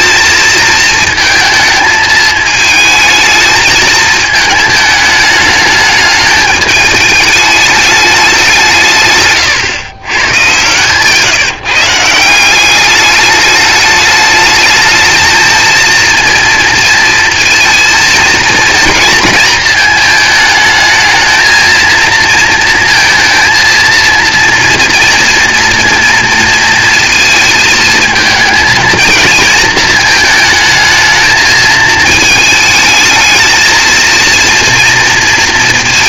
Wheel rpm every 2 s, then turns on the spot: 230, 220, 220, 220, 160, 140, 200, 220, 230, 230, 220, 230, 240, 230, 220, 220, 220, 230.
10-12